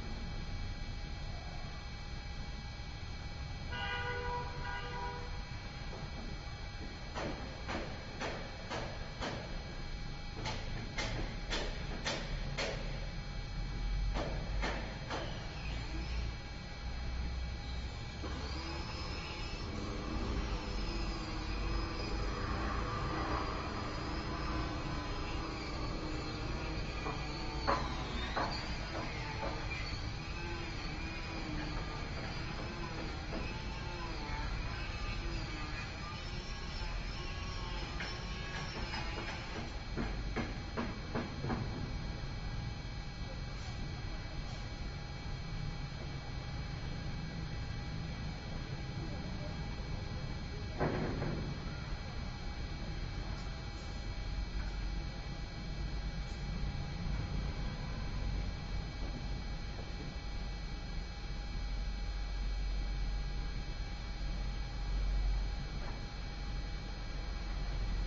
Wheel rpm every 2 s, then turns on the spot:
0, 0, 0, 0, 0, 0, 0, 0, 0, 0, 0, 0, 0, 0, 0, 0, 0, 0, 0, 0, 0, 0, 0, 0, 0, 0, 0, 0, 0, 0, 0, 0, 0, 0.
none